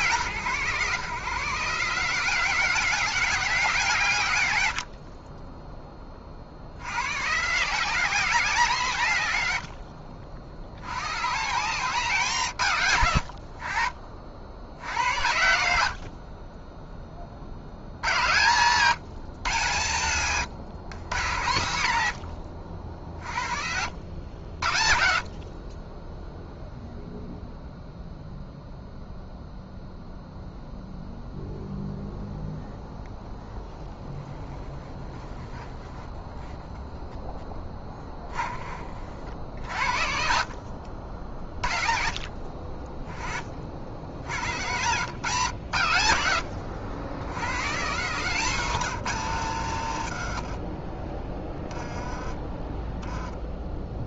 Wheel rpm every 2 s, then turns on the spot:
150, 190, 160, 50, 190, 70, 190, 60, 20, 120, 120, 70, 70, 0, 0, 0, 0, 10, 10, 20, 70, 40, 100, 90, 160, 50, 10.
34-36 48-52